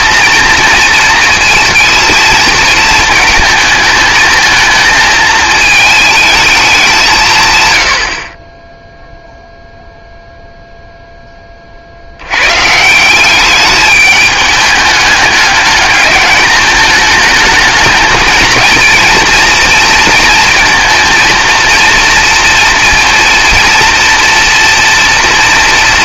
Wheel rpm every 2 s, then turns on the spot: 230, 220, 220, 200, 10, 0, 150, 210, 210, 230, 230, 230, 230.
none